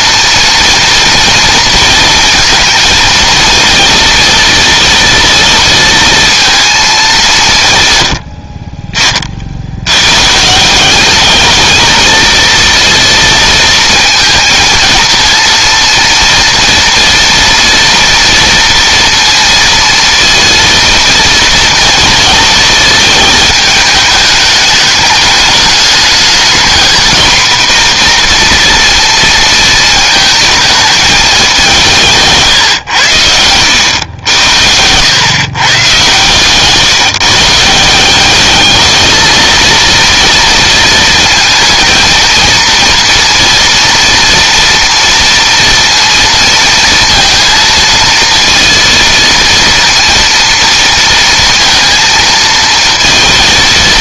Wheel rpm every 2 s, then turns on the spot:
230, 230, 230, 210, 30, 200, 230, 230, 230, 230, 230, 220, 210, 240, 230, 200, 90, 120, 150, 220, 220, 230, 230, 230, 230, 230, 230.
none